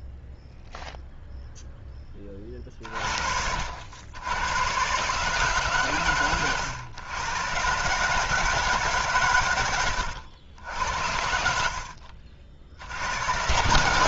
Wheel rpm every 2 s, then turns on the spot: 0, 40, 110, 110, 150, 80, 70.
none